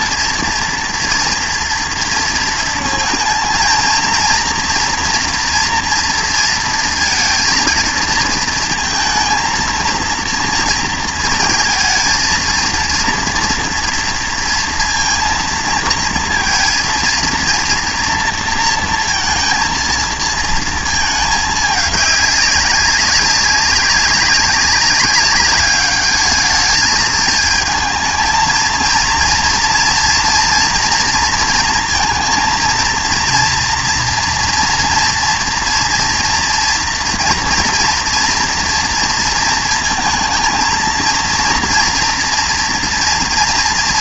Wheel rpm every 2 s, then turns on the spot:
230, 230, 230, 230, 230, 230, 230, 230, 230, 230, 230, 200, 200, 220, 220, 230, 230, 230, 230, 240, 220, 230.
none